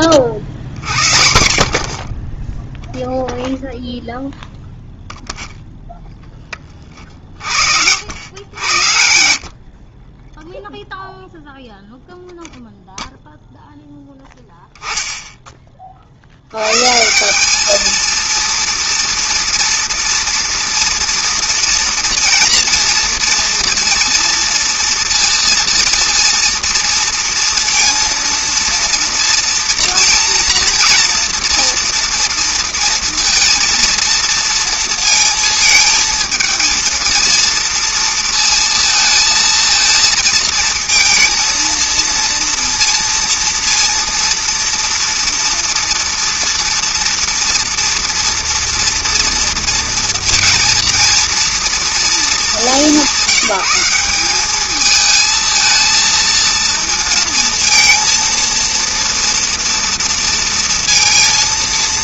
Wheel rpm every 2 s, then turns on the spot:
70, 10, 0, 30, 90, 0, 0, 0, 100, 230, 230, 230, 230, 230, 230, 230, 230, 230, 230, 230, 230, 230, 230, 230, 240, 230, 200, 210, 230, 230, 230.
none